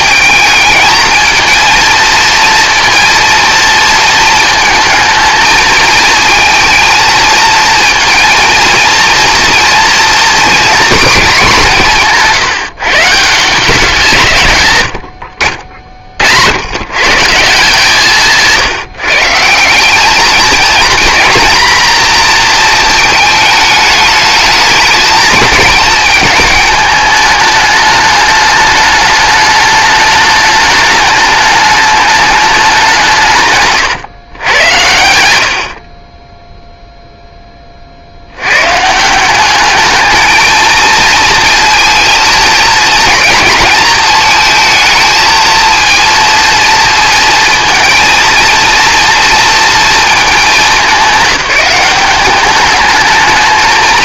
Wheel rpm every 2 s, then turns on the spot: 230, 230, 220, 230, 240, 170, 120, 60, 160, 210, 240, 210, 220, 210, 210, 210, 110, 10, 60, 220, 230, 220, 230, 230, 230, 200, 170.
none